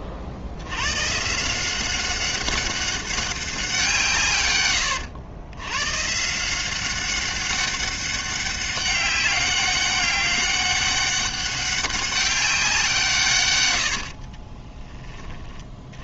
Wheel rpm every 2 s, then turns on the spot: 80, 190, 110, 170, 190, 200, 190, 30.
14-16